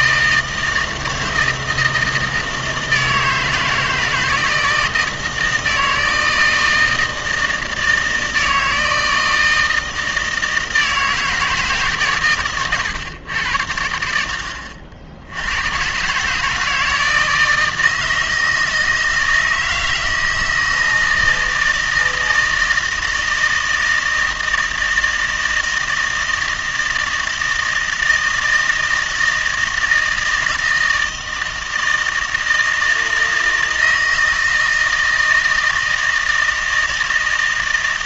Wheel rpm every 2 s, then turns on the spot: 160, 160, 160, 160, 160, 160, 130, 70, 150, 160, 160, 160, 160, 160, 160, 160, 160, 160, 160.
none